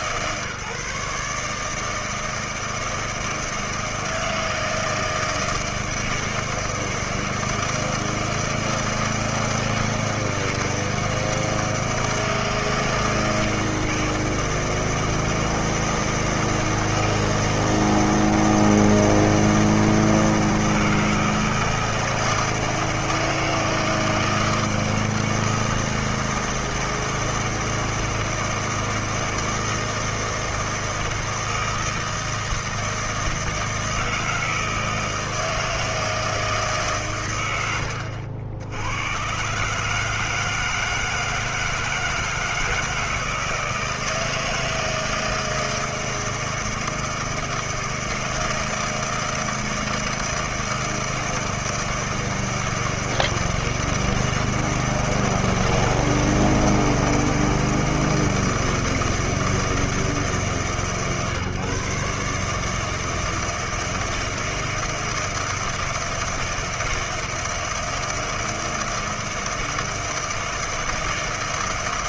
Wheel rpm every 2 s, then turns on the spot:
150, 160, 160, 160, 160, 160, 160, 160, 160, 160, 160, 160, 160, 160, 160, 160, 160, 160, 160, 80, 160, 160, 160, 160, 160, 160, 160, 160, 160, 160, 150, 150, 160, 160, 160, 160.
none